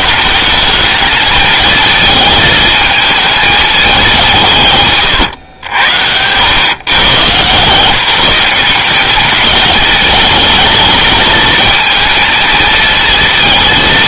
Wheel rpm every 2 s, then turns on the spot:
220, 220, 140, 130, 200, 220, 230.
none